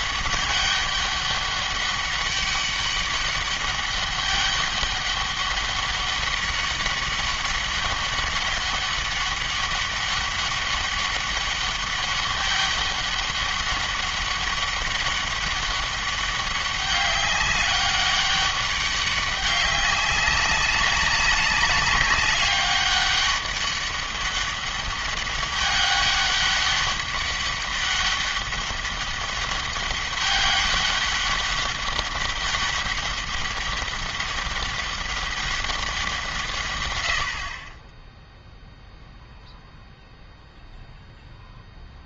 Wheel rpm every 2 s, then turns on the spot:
200, 200, 200, 200, 200, 200, 200, 200, 200, 200, 200, 200, 200, 200, 200, 200, 200, 200, 130, 0, 0.
none